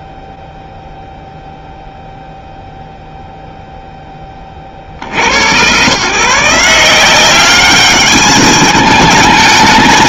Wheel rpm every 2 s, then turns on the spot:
0, 0, 0, 90, 190.
none